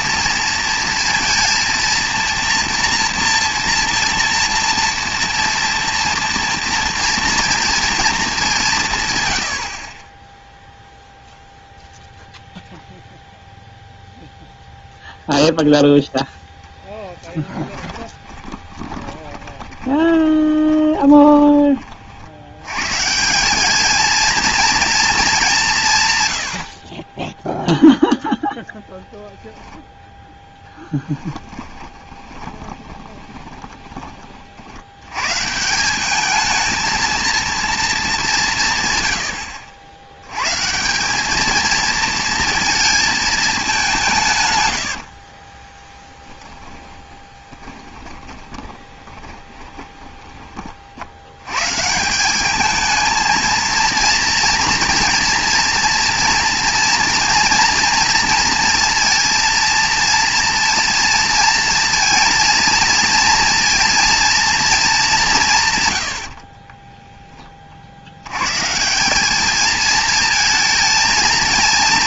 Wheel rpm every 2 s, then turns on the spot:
230, 230, 230, 230, 170, 0, 0, 0, 0, 20, 20, 110, 230, 70, 0, 10, 30, 80, 220, 140, 180, 220, 90, 10, 20, 40, 220, 240, 230, 230, 230, 230, 220, 20, 140, 230.
18-22 30-34 44-50 66-68